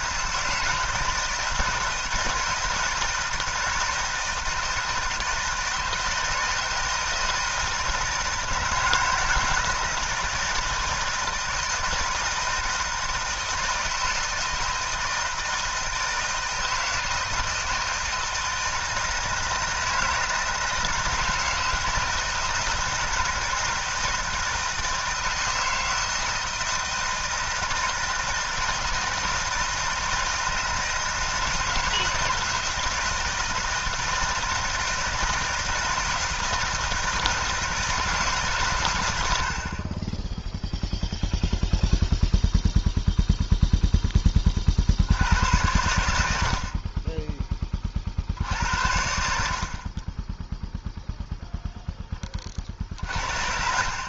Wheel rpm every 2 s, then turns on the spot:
160, 160, 160, 160, 160, 160, 160, 160, 160, 160, 160, 160, 160, 160, 170, 160, 160, 160, 160, 120, 0, 0, 40, 40, 80, 0, 50.
none